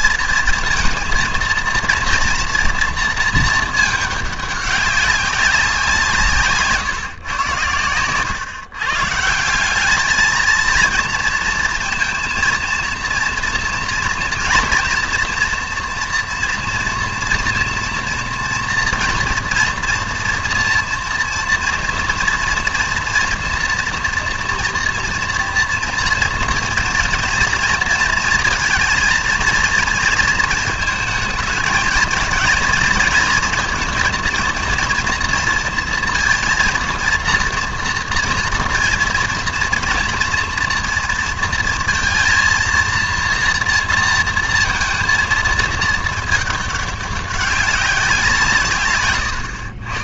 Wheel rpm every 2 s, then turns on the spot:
230, 230, 200, 150, 130, 220, 230, 240, 230, 230, 240, 230, 230, 230, 230, 220, 220, 230, 230, 230, 230, 230, 230, 210, 160.
none